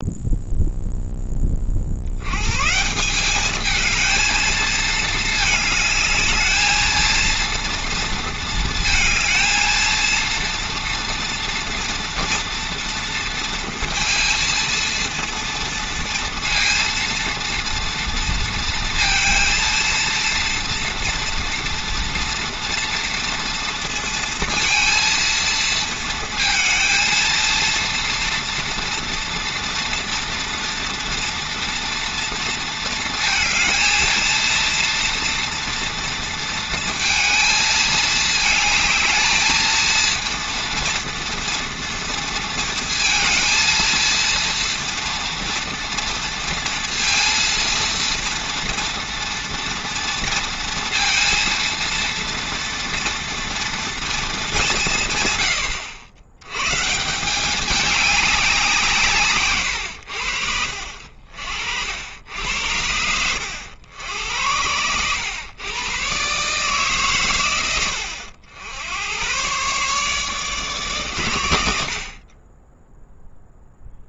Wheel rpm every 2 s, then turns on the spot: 0, 140, 220, 220, 230, 230, 230, 230, 230, 230, 230, 230, 230, 230, 230, 230, 230, 230, 230, 220, 230, 230, 230, 230, 230, 230, 230, 180, 130, 170, 60, 80, 90, 140, 80, 140, 10.
none